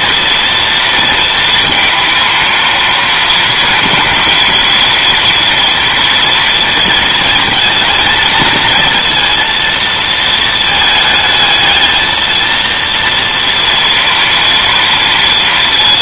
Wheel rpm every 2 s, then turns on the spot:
230, 230, 230, 220, 230, 220, 230, 230.
none